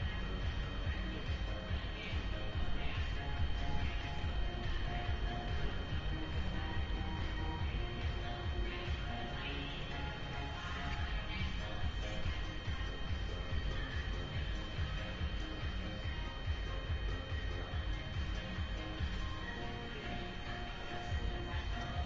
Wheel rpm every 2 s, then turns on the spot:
0, 0, 0, 0, 0, 0, 0, 0, 0, 0, 0.
none